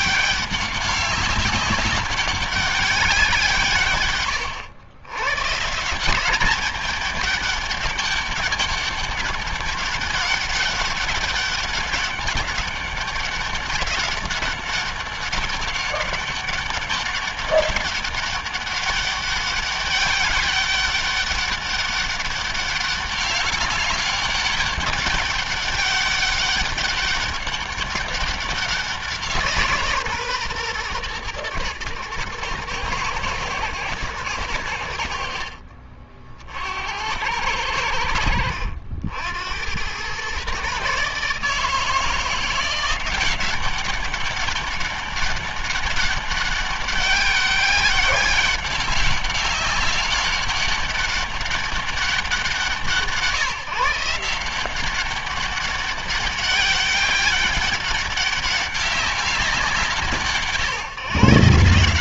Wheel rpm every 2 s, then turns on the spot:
200, 190, 110, 200, 200, 200, 200, 190, 200, 200, 200, 200, 200, 200, 180, 120, 110, 80, 70, 70, 140, 180, 200, 200, 190, 200, 170, 180, 200, 200, 150.
none